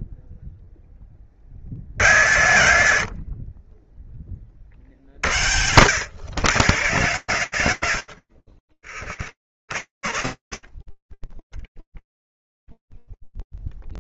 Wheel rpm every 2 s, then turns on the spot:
20, 60, 60, 130, 20, 20, 0.
none